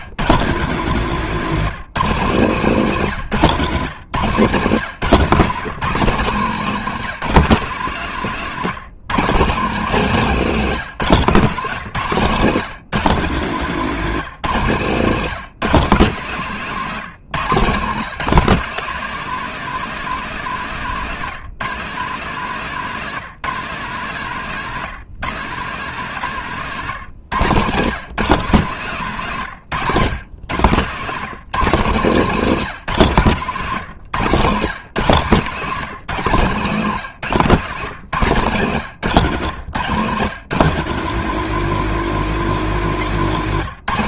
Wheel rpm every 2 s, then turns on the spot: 200, 170, 150, 190, 180, 190, 180, 170, 170, 220, 190, 180, 180, 160, 160, 160, 170, 160, 150, 140, 170, 190.
34-40